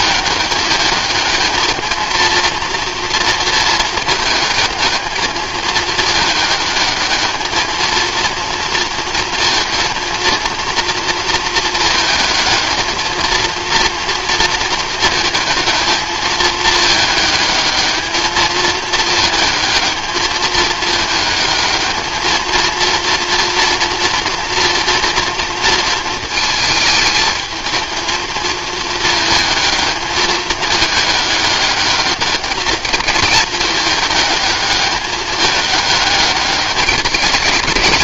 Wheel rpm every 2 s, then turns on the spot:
210, 230, 220, 210, 230, 230, 220, 230, 220, 220, 220, 230, 230, 220, 220, 210, 220, 210, 210.
none